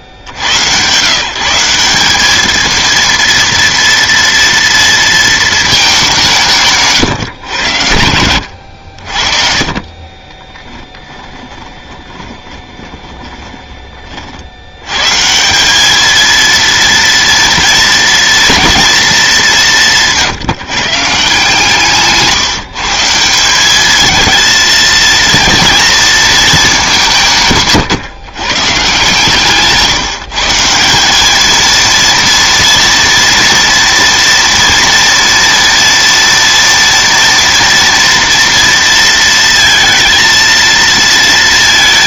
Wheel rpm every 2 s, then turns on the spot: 50, 220, 230, 170, 90, 20, 20, 70, 230, 230, 170, 150, 220, 220, 130, 160, 230, 230, 230, 230, 230.
8-14